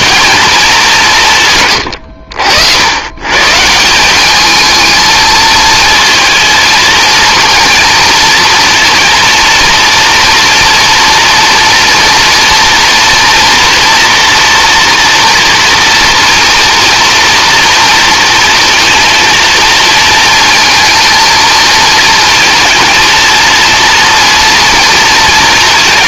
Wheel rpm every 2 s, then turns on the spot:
230, 80, 200, 230, 230, 230, 230, 230, 240, 230, 230, 230, 230.
none